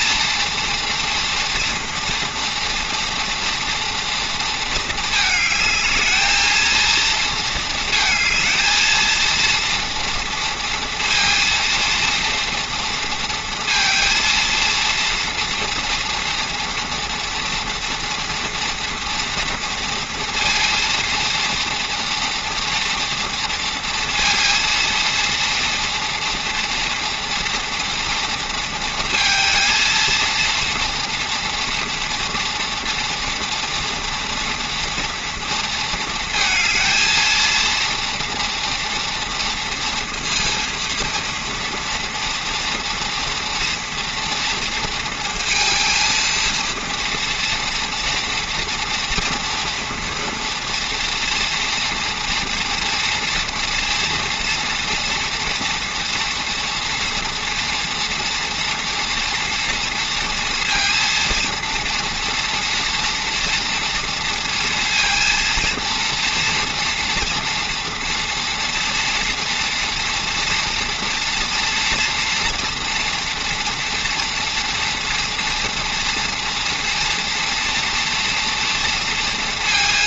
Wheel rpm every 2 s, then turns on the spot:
230, 230, 220, 230, 220, 230, 230, 230, 230, 240, 230, 230, 230, 230, 230, 230, 230, 230, 230, 230, 230, 240, 230, 230, 230, 240, 240, 240, 230, 230, 230, 230, 230, 240, 230, 230, 230, 230, 230, 240.
none